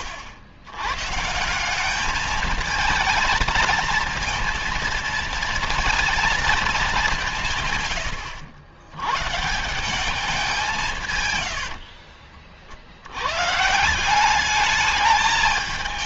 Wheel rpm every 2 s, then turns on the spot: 90, 220, 230, 220, 100, 180, 50, 200.
none